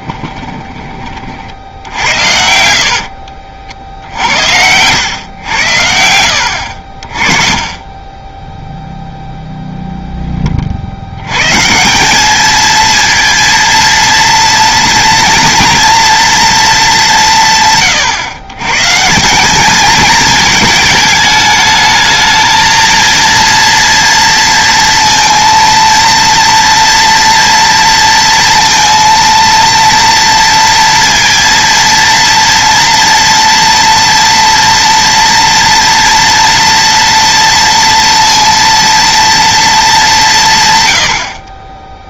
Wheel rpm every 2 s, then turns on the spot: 30, 70, 100, 60, 0, 60, 230, 230, 210, 140, 220, 220, 230, 230, 230, 230, 230, 230, 230, 230, 130.
2-4